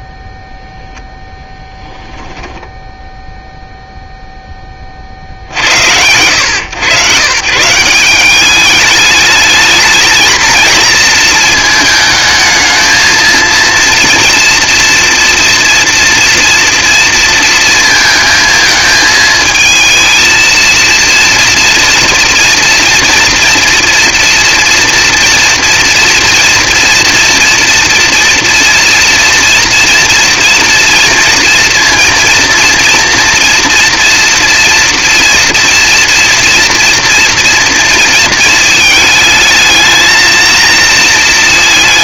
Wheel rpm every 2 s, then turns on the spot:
0, 10, 10, 120, 210, 230, 220, 230, 230, 220, 230, 240, 230, 230, 230, 230, 230, 240, 240, 220, 230.
2-4